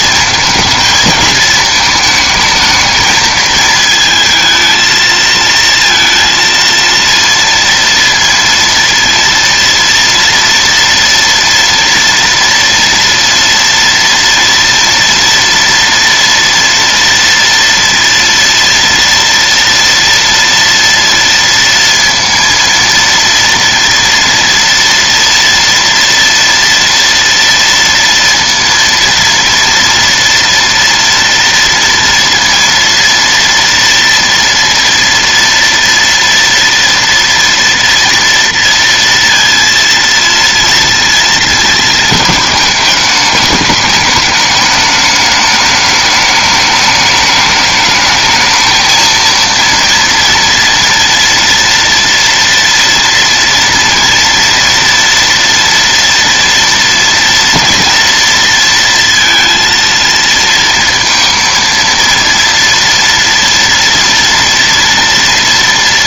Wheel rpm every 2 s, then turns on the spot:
230, 220, 220, 230, 230, 230, 230, 230, 230, 230, 230, 230, 230, 230, 230, 230, 230, 230, 230, 230, 230, 220, 210, 210, 220, 230, 230, 230, 240, 230, 230, 230, 230.
none